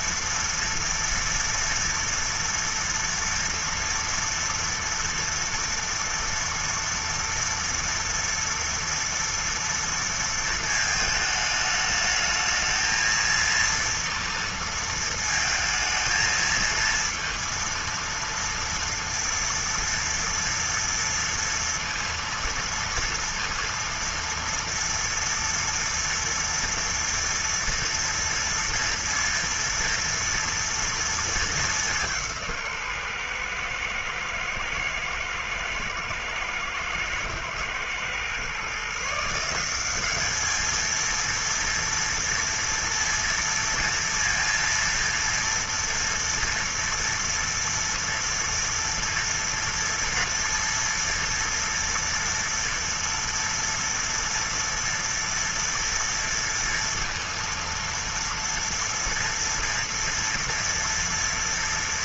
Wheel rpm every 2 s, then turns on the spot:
230, 230, 230, 230, 230, 230, 210, 230, 230, 230, 230, 230, 230, 230, 230, 230, 180, 110, 110, 120, 200, 230, 230, 240, 230, 230, 230, 230, 230, 230, 230.
none